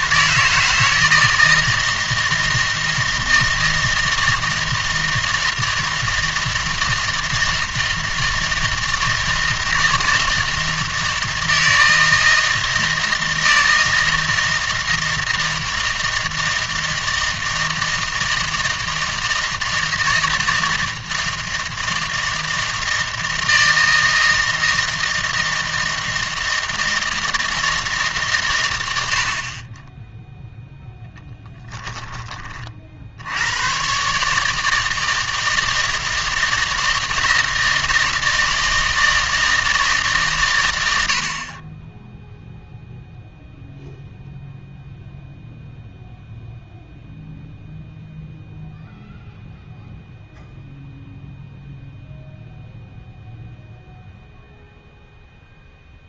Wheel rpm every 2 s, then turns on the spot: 160, 160, 160, 160, 160, 160, 160, 160, 160, 160, 160, 160, 160, 160, 110, 0, 40, 160, 160, 160, 110, 0, 0, 0, 0, 0, 0, 0.
none